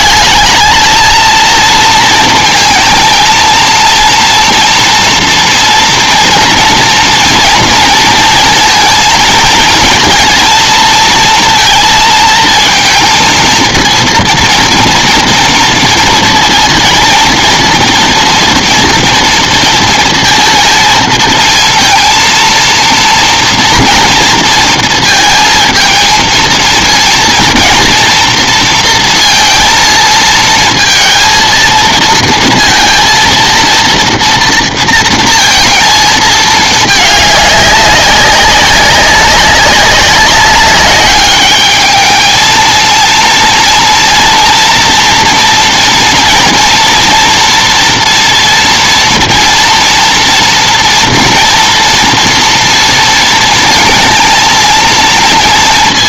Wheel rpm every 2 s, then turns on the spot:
220, 230, 240, 230, 230, 230, 230, 230, 230, 240, 230, 230, 230, 230, 230, 230, 230, 230, 220, 200, 200, 220, 230, 230, 230, 230, 230, 230.
none